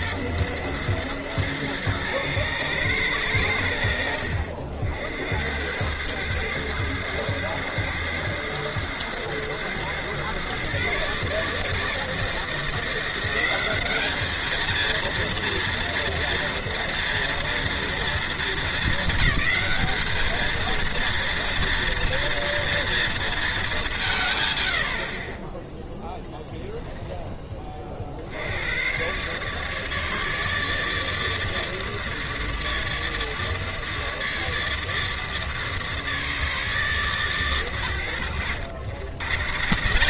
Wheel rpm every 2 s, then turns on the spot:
110, 110, 70, 110, 110, 130, 160, 220, 230, 230, 220, 230, 110, 10, 90, 160, 150, 150, 160, 90.
26-28